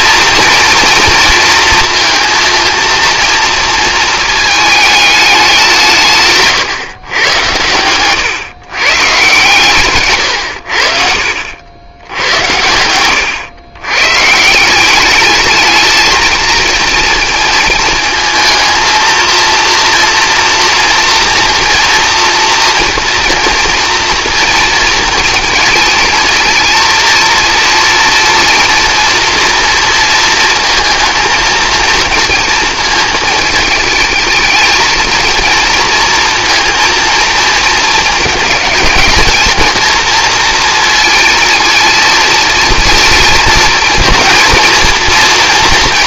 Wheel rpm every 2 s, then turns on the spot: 230, 230, 220, 140, 140, 80, 90, 180, 220, 220, 230, 230, 230, 230, 230, 230, 230, 220, 230, 220, 230, 230, 230.
12-14